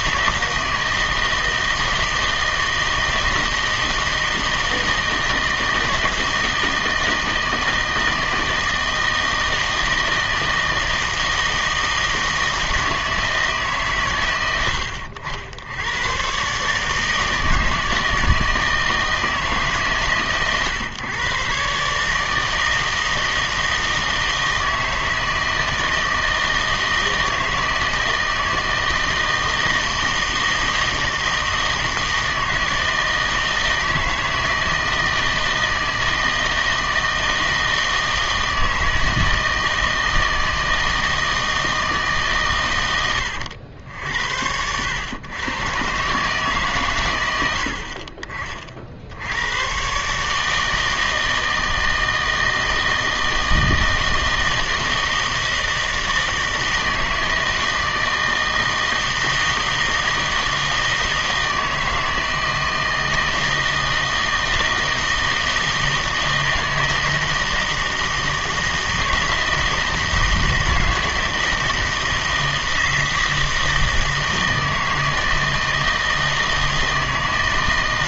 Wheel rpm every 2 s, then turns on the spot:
160, 160, 160, 160, 160, 160, 160, 100, 140, 160, 130, 160, 160, 160, 160, 160, 160, 160, 160, 160, 160, 120, 90, 140, 40, 160, 160, 160, 160, 160, 160, 160, 160, 160, 160, 160, 160, 160, 160.
none